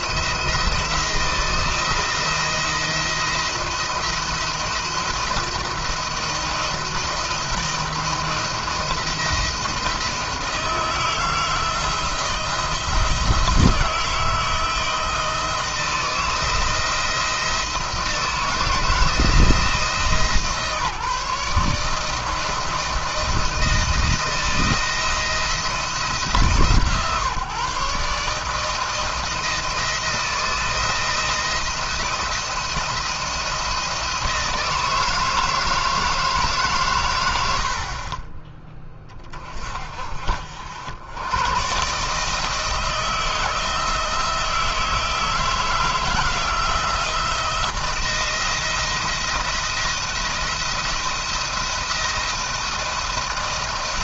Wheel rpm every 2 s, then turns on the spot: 170, 170, 170, 170, 170, 160, 170, 170, 160, 160, 160, 170, 170, 160, 160, 170, 170, 170, 140, 20, 70, 150, 160, 160, 170, 170, 170.
none